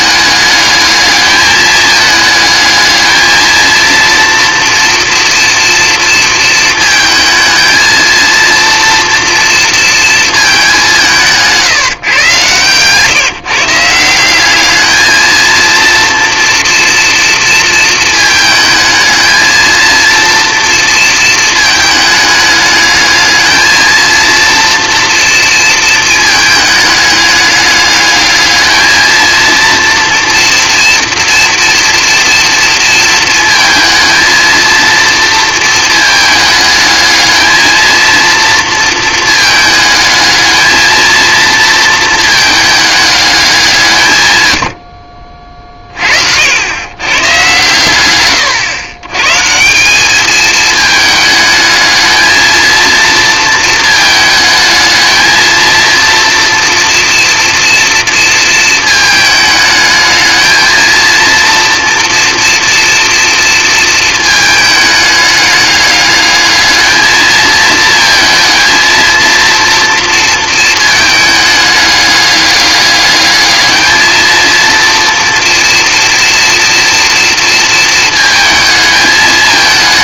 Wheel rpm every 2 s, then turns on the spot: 210, 220, 230, 220, 230, 190, 130, 220, 230, 220, 230, 210, 230, 210, 220, 240, 230, 230, 210, 220, 220, 210, 70, 130, 110, 220, 230, 220, 240, 220, 220, 230, 210, 220, 230, 220, 210, 230, 240, 220.
none